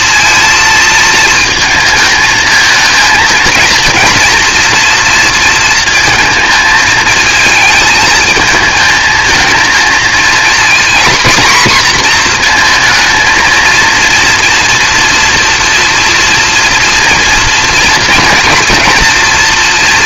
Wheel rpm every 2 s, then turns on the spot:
230, 230, 240, 220, 220, 230, 230, 230, 230, 230.
none